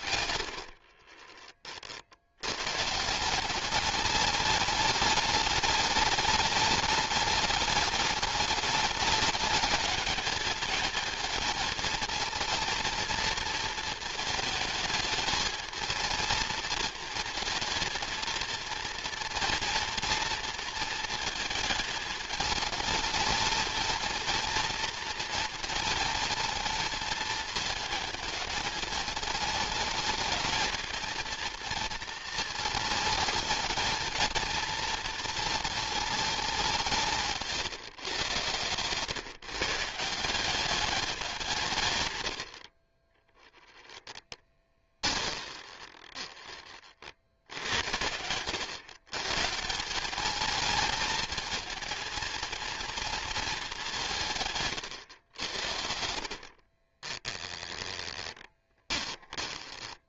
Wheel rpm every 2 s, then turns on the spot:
70, 130, 210, 210, 210, 220, 220, 210, 220, 230, 230, 220, 230, 220, 210, 220, 220, 230, 180, 120, 200, 40, 20, 30, 100, 220, 230, 120, 30, 20.
0-2 38-40 44-46 54-60